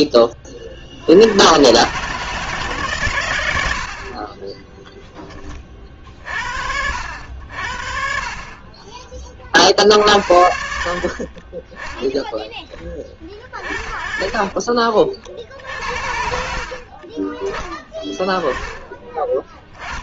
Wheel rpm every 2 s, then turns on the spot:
40, 130, 10, 70, 50, 60, 30, 40, 40, 20.
none